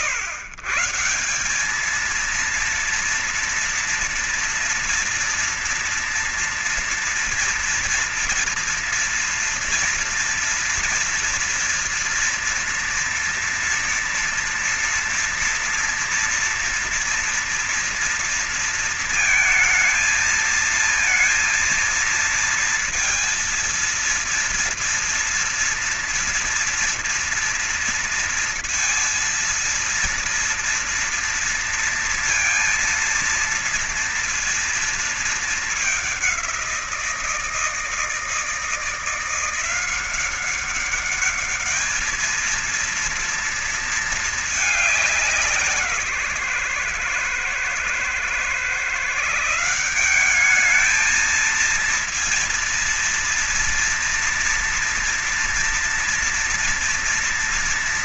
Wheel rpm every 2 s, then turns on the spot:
130, 230, 230, 230, 230, 230, 240, 240, 230, 230, 230, 230, 230, 230, 230, 230, 230, 230, 190, 160, 190, 220, 210, 130, 130, 200, 230, 230, 230.
none